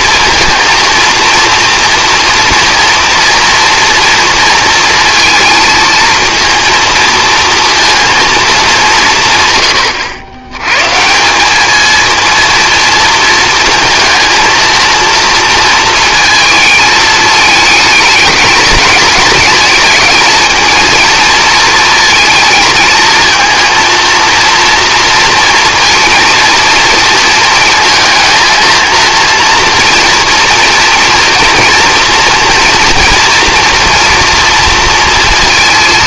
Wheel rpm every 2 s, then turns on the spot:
230, 230, 230, 230, 200, 120, 230, 230, 220, 220, 230, 230, 230, 230, 230, 230, 230, 230.
none